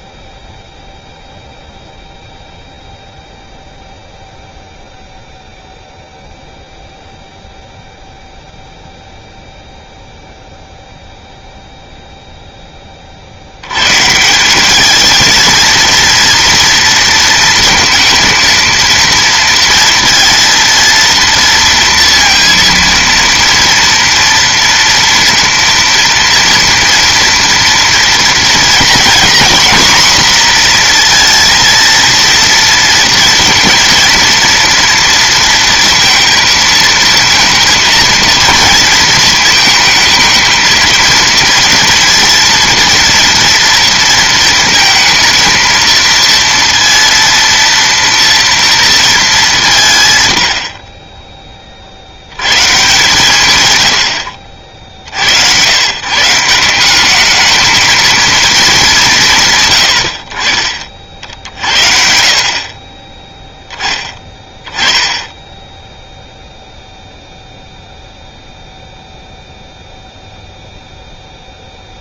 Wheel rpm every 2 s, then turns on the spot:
0, 0, 0, 0, 0, 0, 70, 220, 230, 230, 230, 230, 230, 230, 230, 240, 230, 230, 230, 230, 230, 230, 230, 230, 210, 10, 140, 60, 190, 190, 50, 30, 10, 0, 0, 0.
none